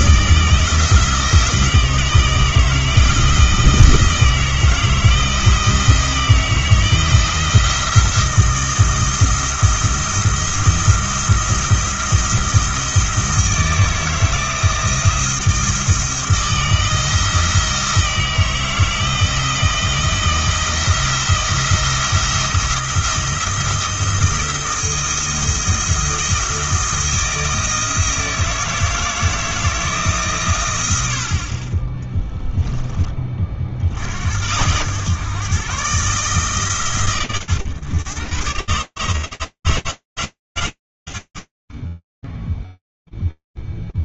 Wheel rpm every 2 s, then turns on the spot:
160, 160, 160, 170, 170, 170, 170, 170, 160, 160, 170, 170, 170, 170, 160, 120, 10, 100, 130, 120, 100, 0.
none